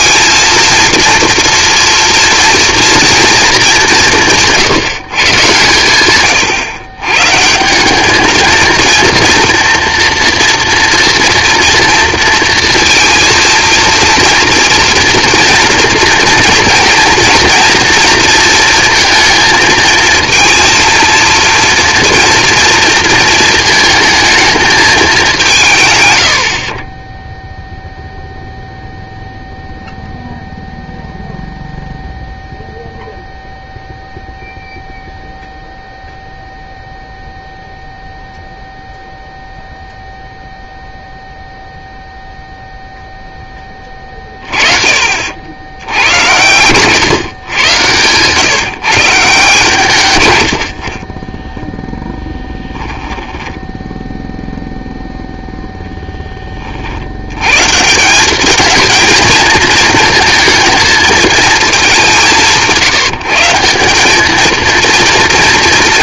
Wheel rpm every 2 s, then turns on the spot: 230, 230, 160, 120, 230, 230, 230, 230, 230, 230, 230, 230, 220, 50, 0, 0, 0, 0, 0, 0, 0, 0, 40, 120, 140, 70, 10, 0, 40, 210, 230, 170, 220.
50-54